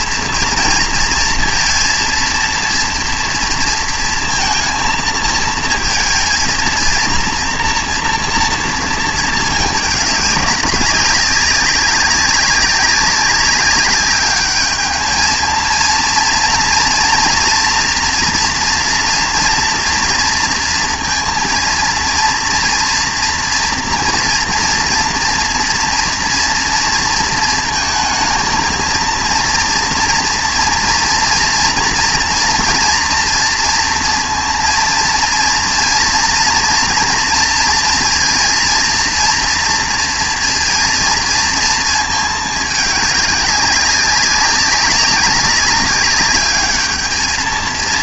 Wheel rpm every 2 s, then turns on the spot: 230, 230, 230, 230, 230, 200, 200, 210, 230, 230, 230, 230, 230, 230, 230, 230, 230, 230, 230, 230, 230, 210, 200, 210.
none